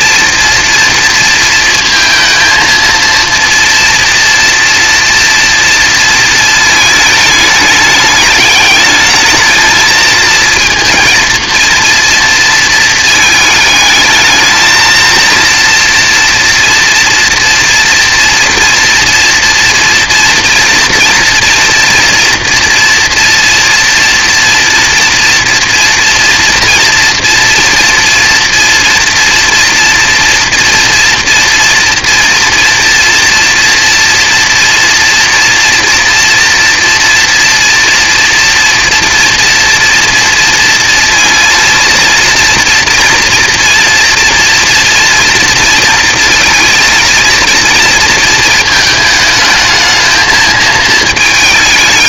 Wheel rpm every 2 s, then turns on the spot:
230, 220, 230, 220, 210, 230, 230, 220, 230, 230, 230, 240, 230, 230, 230, 230, 240, 230, 230, 230, 230, 230, 240, 230, 220, 220.
none